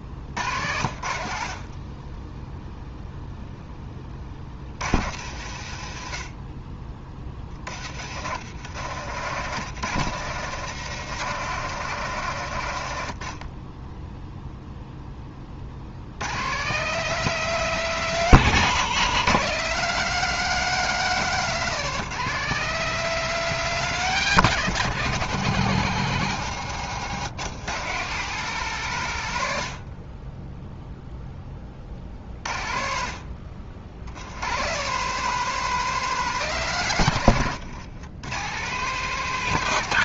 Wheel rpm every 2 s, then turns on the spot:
70, 0, 60, 30, 100, 130, 90, 0, 150, 150, 190, 190, 170, 140, 160, 10, 50, 130, 160, 140.
none